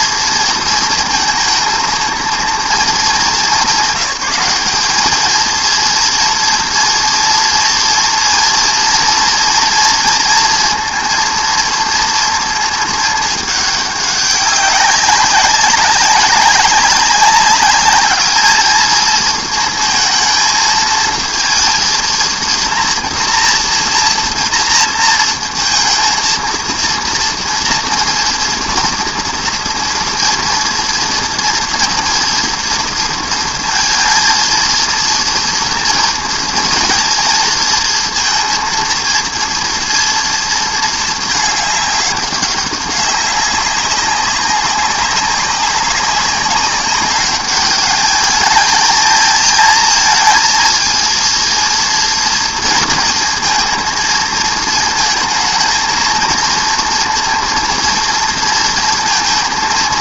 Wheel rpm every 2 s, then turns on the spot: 230, 230, 190, 230, 230, 230, 230, 200, 190, 220, 220, 230, 230, 230, 230, 230, 230, 230, 230, 230, 230, 200, 200, 200, 220, 230, 230, 220, 230, 230.
none